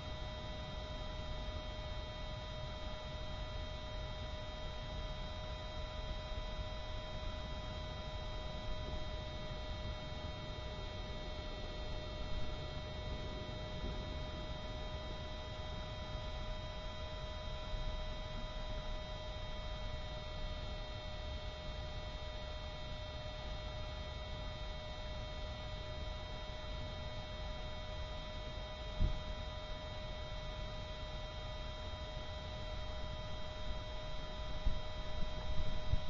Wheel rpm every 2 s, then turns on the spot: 0, 0, 0, 0, 0, 0, 0, 0, 0, 0, 0, 0, 0, 0, 0, 0, 0, 0.
none